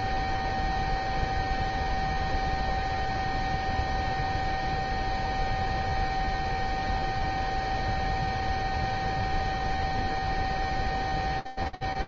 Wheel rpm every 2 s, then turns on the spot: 0, 0, 0, 0, 0, 0.
none